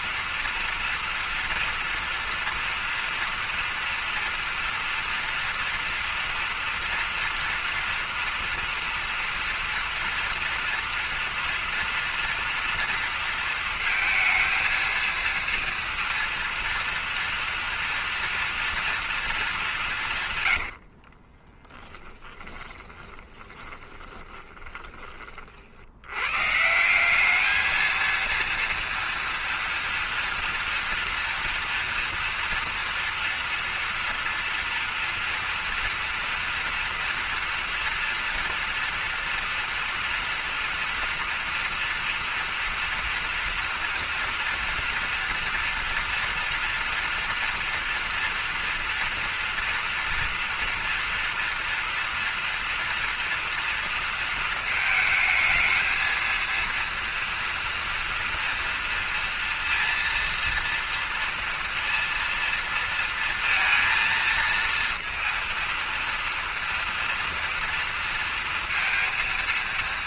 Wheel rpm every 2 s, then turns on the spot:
230, 230, 230, 230, 230, 230, 230, 220, 230, 230, 120, 20, 30, 140, 230, 230, 230, 230, 230, 230, 230, 240, 230, 240, 230, 230, 230, 220, 230, 230, 230, 230, 230, 230, 230.
20-26